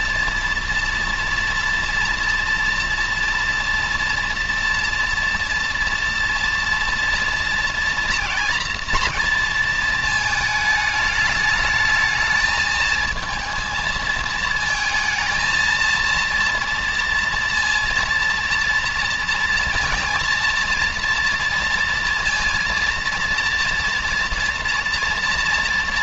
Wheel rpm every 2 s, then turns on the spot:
230, 230, 230, 230, 230, 210, 220, 220, 230, 230, 230, 230, 230.
none